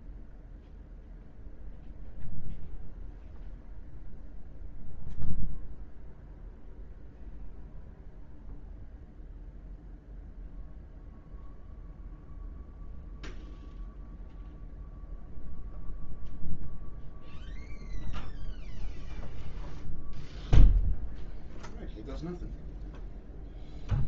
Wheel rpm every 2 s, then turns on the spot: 0, 0, 0, 0, 0, 0, 0, 0, 0, 0, 0, 0.
none